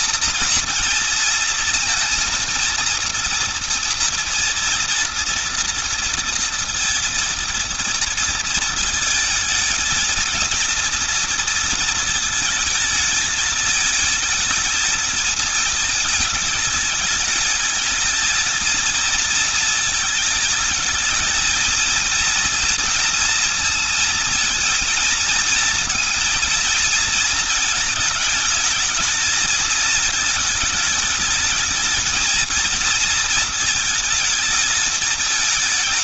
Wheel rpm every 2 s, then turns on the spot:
230, 230, 230, 230, 220, 230, 220, 220, 210, 230, 220, 230, 230, 230, 210, 210, 230, 220.
none